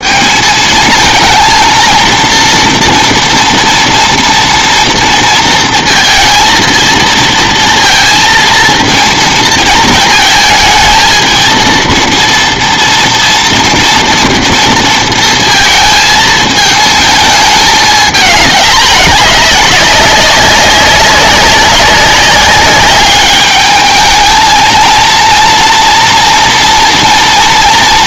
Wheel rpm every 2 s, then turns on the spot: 220, 230, 230, 230, 230, 220, 230, 230, 220, 210, 190, 200, 230, 230.
none